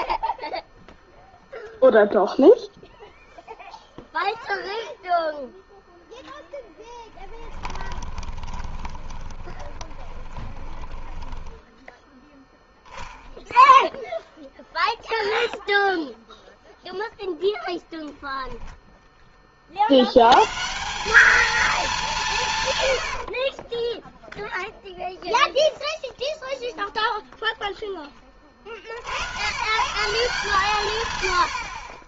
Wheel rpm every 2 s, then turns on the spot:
20, 0, 0, 0, 20, 20, 0, 0, 0, 0, 130, 130, 0, 0, 40, 160.
8-12